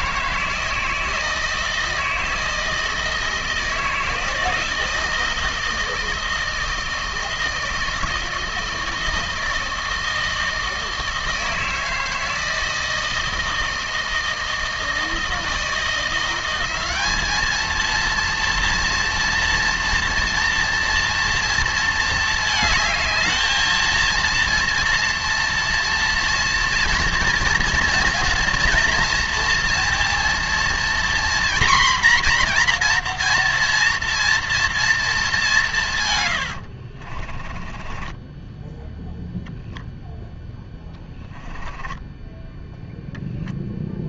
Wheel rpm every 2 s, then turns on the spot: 160, 160, 160, 160, 160, 160, 160, 160, 190, 230, 240, 220, 230, 230, 240, 240, 240, 230, 70, 10, 20, 10.
36-42